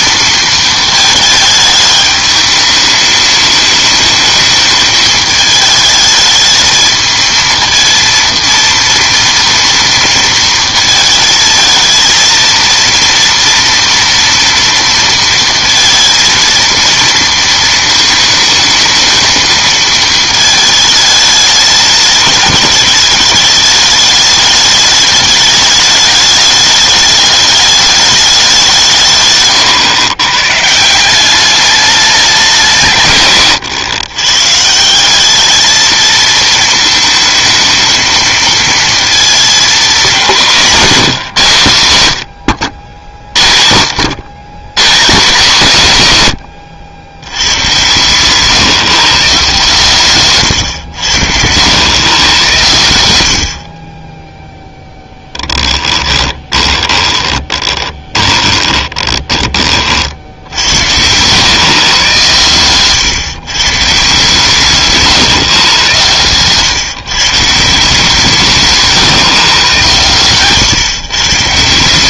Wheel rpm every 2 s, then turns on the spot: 230, 210, 210, 220, 230, 230, 230, 230, 230, 220, 220, 210, 210, 210, 190, 130, 190, 140, 220, 220, 180, 90, 160, 100, 160, 110, 110, 0, 30, 20, 80, 120, 150, 140, 160, 140.
50-52 56-60